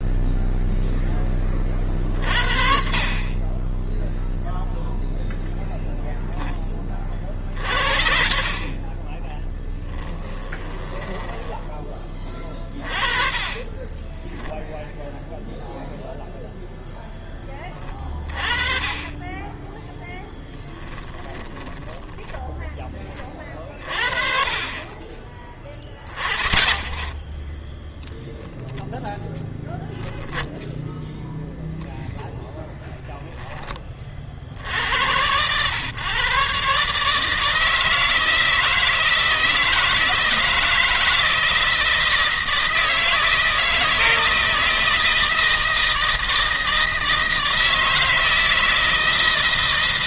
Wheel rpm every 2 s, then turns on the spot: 10, 40, 0, 40, 30, 10, 30, 0, 0, 30, 10, 20, 30, 20, 0, 10, 0, 90, 150, 160, 160, 160, 160, 160, 160.
8-12 20-22 30-32